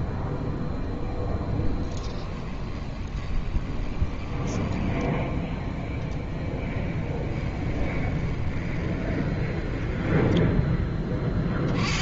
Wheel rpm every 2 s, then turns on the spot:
0, 20, 10, 20, 20, 10.
2-10